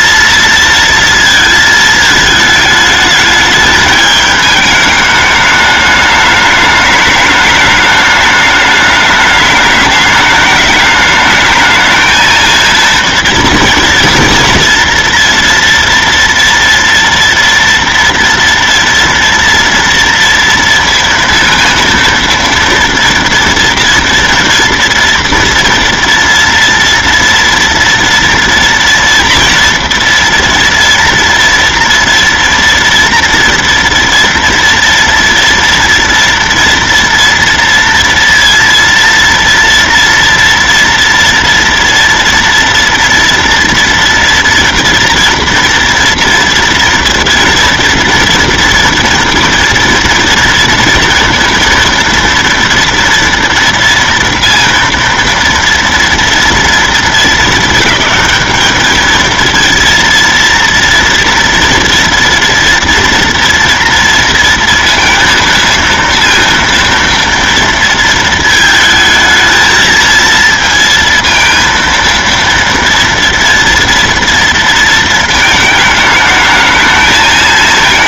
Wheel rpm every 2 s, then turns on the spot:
230, 220, 210, 210, 210, 210, 230, 230, 230, 230, 230, 230, 230, 230, 230, 240, 240, 240, 230, 230, 230, 230, 230, 230, 230, 230, 230, 230, 230, 220, 230, 230, 230, 230, 220, 230, 230, 230, 210.
none